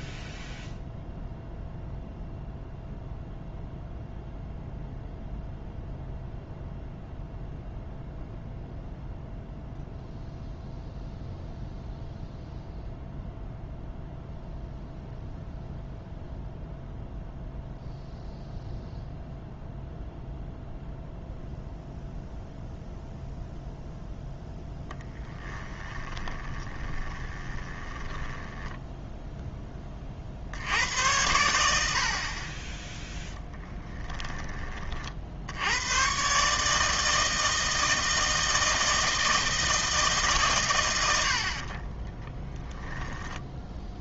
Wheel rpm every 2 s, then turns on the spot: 0, 0, 0, 0, 0, 0, 0, 0, 0, 0, 0, 0, 0, 20, 10, 80, 30, 30, 150, 160, 120, 10.
26-30 42-44